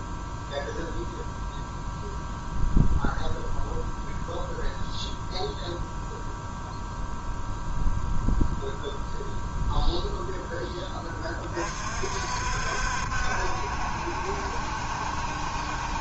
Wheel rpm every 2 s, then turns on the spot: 0, 0, 0, 0, 0, 20, 60, 70.
none